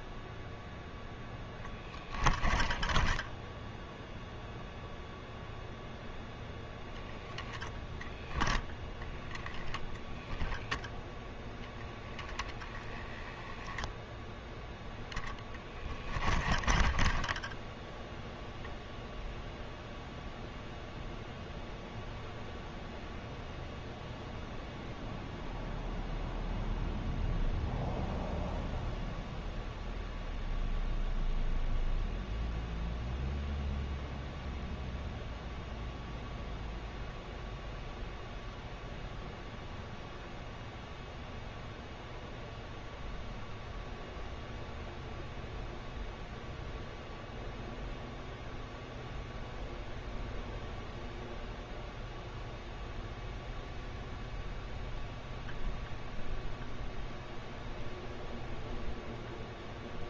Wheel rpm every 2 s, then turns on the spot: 0, 10, 0, 0, 0, 0, 10, 0, 20, 0, 0, 0, 0, 0, 0, 0, 0, 0, 0, 0, 0, 0, 0, 0, 0, 0, 0, 0, 0, 0.
2-4 16-18